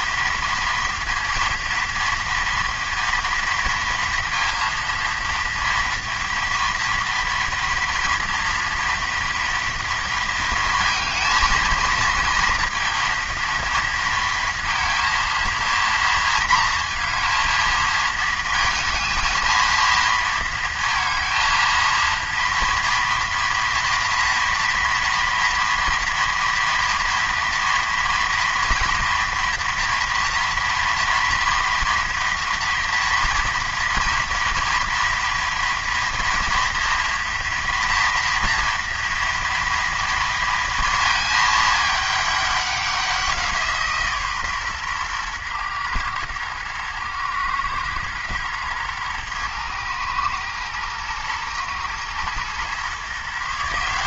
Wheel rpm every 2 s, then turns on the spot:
230, 230, 230, 230, 230, 230, 230, 230, 230, 220, 230, 230, 230, 230, 240, 230, 230, 230, 230, 230, 220, 180, 120, 110, 110, 120, 140.
none